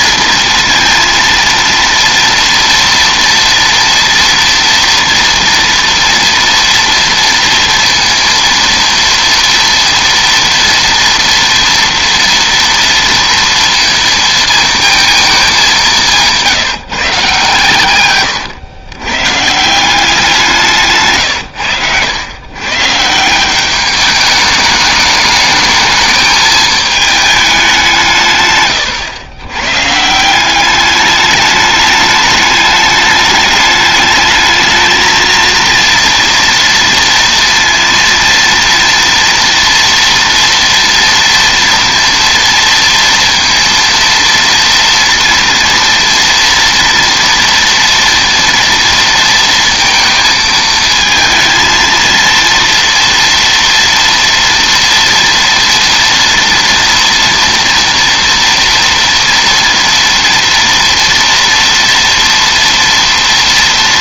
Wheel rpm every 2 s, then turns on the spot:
230, 230, 230, 230, 230, 230, 230, 230, 160, 110, 160, 140, 210, 220, 120, 200, 210, 220, 230, 230, 230, 230, 230, 230, 230, 220, 230, 230, 230, 230, 230, 230.
none